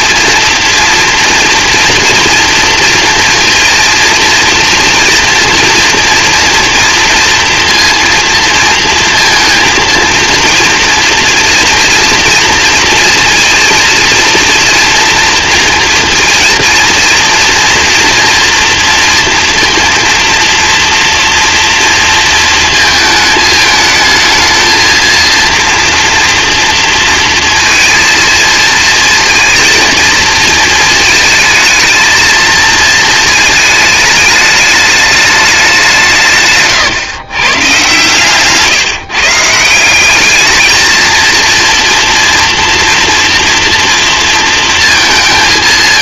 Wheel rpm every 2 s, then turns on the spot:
230, 230, 230, 230, 230, 230, 230, 230, 230, 230, 230, 220, 220, 230, 230, 220, 220, 210, 130, 140, 220, 230, 230.
none